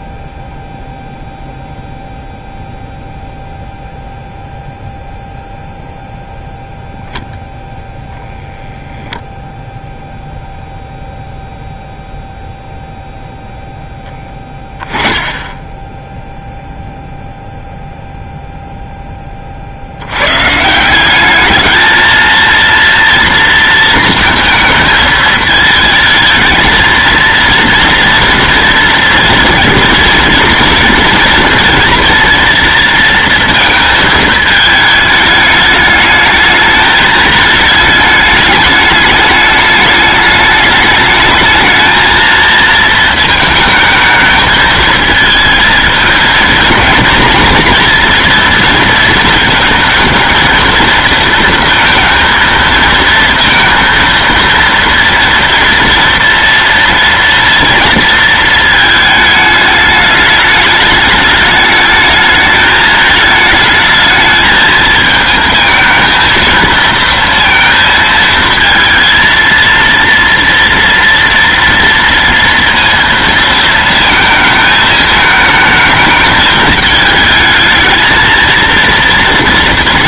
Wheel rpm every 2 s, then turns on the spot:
0, 0, 0, 0, 0, 0, 0, 10, 0, 0, 150, 230, 230, 220, 230, 230, 230, 220, 210, 210, 210, 230, 220, 220, 230, 230, 230, 230, 230, 220, 210, 220, 220, 230, 230, 230, 230, 220, 210, 230.
none